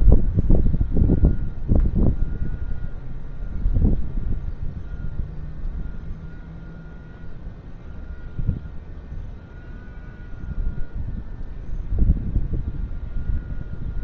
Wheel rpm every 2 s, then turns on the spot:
0, 0, 0, 0, 0, 0, 0.
none